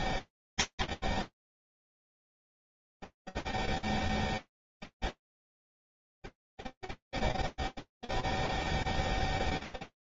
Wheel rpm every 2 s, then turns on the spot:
0, 0, 0, 0, 0.
none